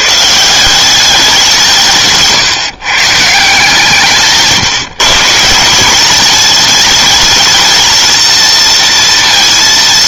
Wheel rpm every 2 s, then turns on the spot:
190, 150, 160, 220, 230.
none